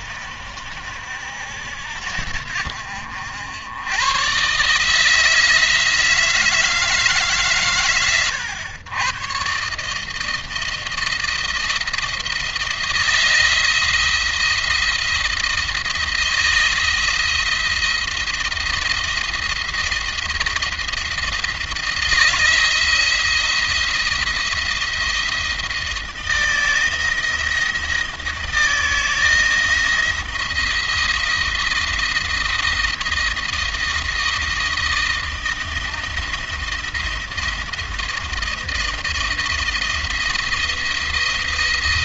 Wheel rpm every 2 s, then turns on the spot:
70, 70, 150, 150, 110, 160, 170, 170, 170, 170, 170, 170, 170, 160, 160, 170, 160, 160, 170, 160, 160.
none